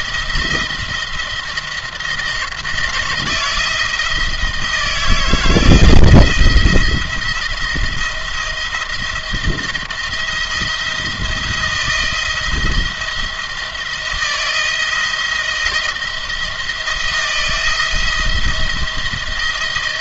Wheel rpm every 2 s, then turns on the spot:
170, 160, 160, 170, 170, 170, 170, 160, 170, 160.
none